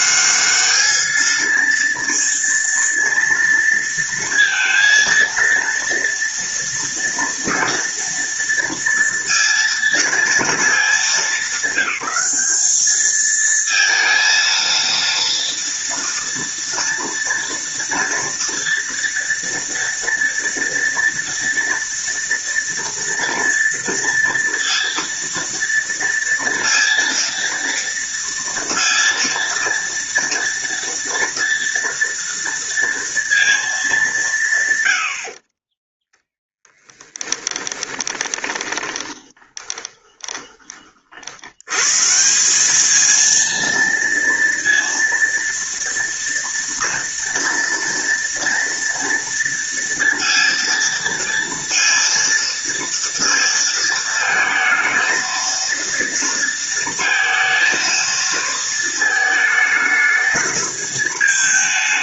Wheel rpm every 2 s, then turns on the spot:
210, 230, 230, 230, 230, 220, 200, 230, 230, 230, 230, 230, 230, 230, 230, 230, 230, 140, 10, 20, 30, 190, 230, 230, 230, 230, 230, 220, 230, 230, 220.
38-40